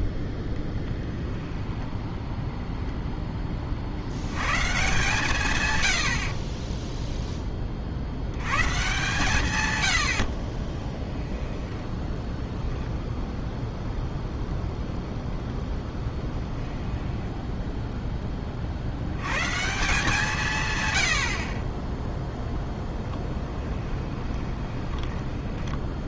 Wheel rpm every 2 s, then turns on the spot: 0, 0, 130, 20, 130, 40, 0, 0, 10, 50, 140, 0, 20.
6-8 16-18 24-26